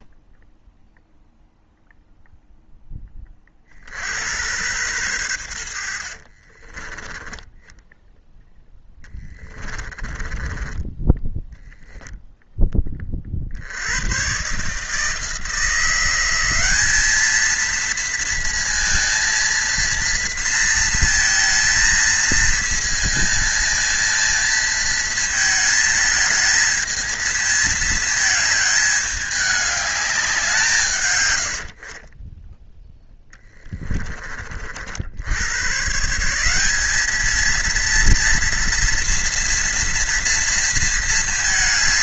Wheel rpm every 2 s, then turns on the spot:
0, 0, 100, 50, 0, 20, 0, 130, 180, 230, 230, 230, 230, 220, 220, 180, 20, 40, 170, 230, 230.
6-8 10-12